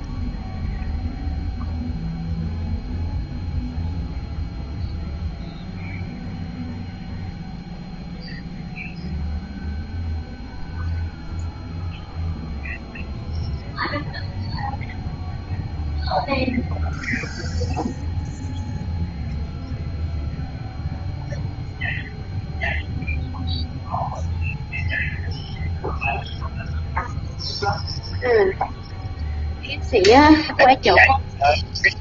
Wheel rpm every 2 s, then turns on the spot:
0, 0, 0, 0, 0, 0, 0, 0, 0, 0, 0, 0, 0, 0, 0, 0.
none